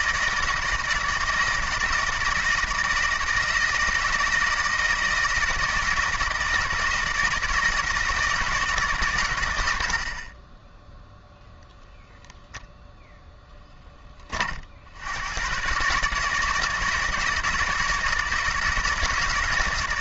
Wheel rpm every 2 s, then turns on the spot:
160, 160, 160, 160, 150, 10, 0, 70, 160, 160.
none